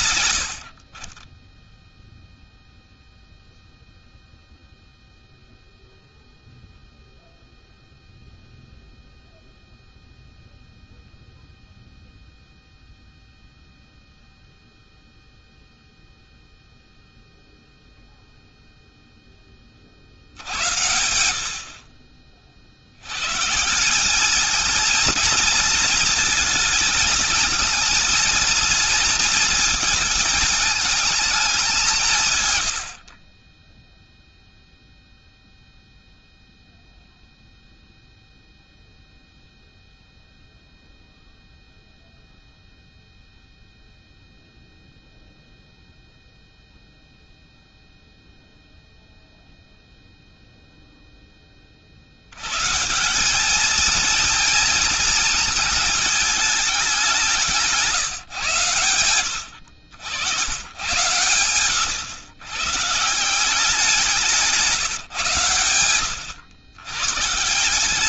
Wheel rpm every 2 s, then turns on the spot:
60, 0, 0, 0, 0, 0, 0, 0, 0, 10, 80, 110, 230, 220, 220, 210, 50, 0, 0, 0, 0, 0, 0, 0, 0, 0, 160, 220, 200, 110, 110, 150, 150, 120.
none